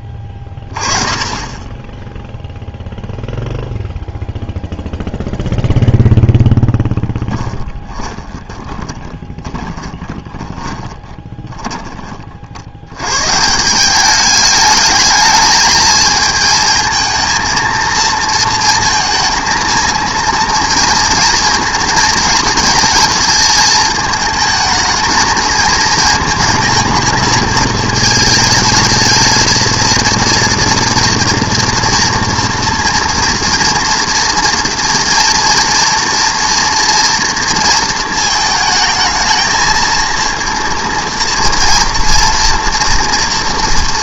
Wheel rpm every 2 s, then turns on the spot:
20, 0, 0, 10, 10, 20, 90, 210, 230, 230, 230, 230, 220, 220, 220, 230, 230, 230, 230, 220, 230, 230.
6-12